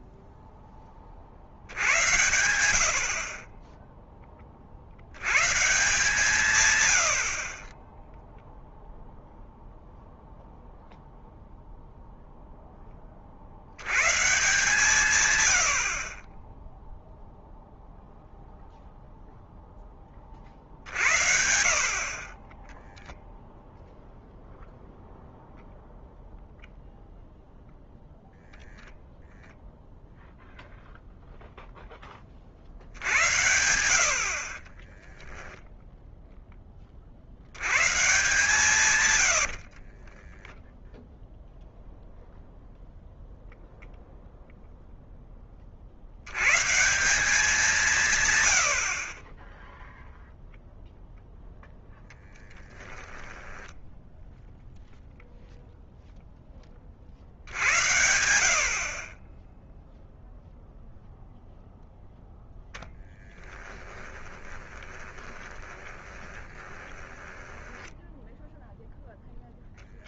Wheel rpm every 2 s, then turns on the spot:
20, 70, 50, 110, 0, 0, 0, 130, 20, 0, 60, 30, 0, 0, 0, 0, 50, 40, 10, 120, 10, 0, 0, 130, 100, 0, 10, 0, 20, 60, 0, 0, 20, 20, 0.
22-24 34-36 40-42 52-54 64-68